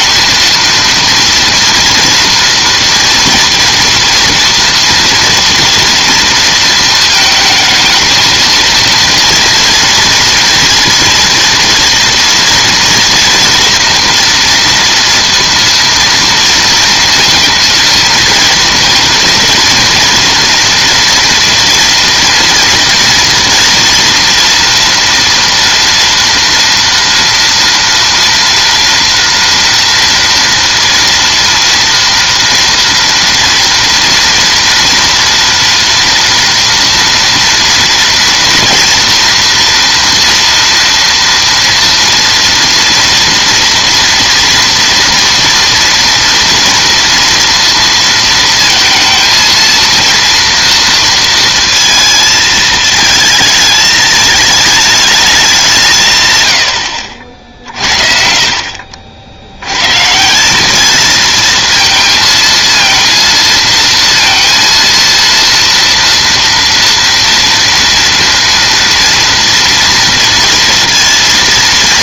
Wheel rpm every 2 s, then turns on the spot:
230, 230, 230, 230, 230, 230, 230, 230, 230, 230, 230, 230, 230, 230, 230, 230, 230, 230, 230, 230, 230, 230, 230, 230, 220, 230, 220, 220, 90, 50, 200, 220, 230, 230, 230, 230.
none